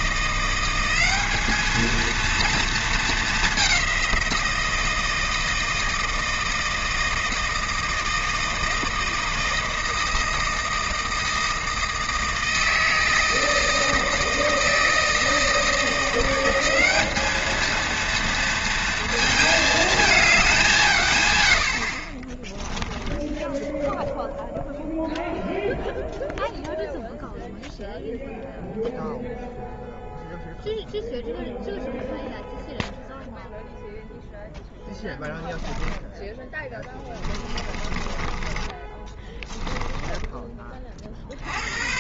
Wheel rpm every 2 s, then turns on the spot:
180, 230, 170, 160, 160, 160, 160, 160, 190, 230, 190, 10, 0, 0, 0, 0, 0, 0, 10, 20, 20.
36-40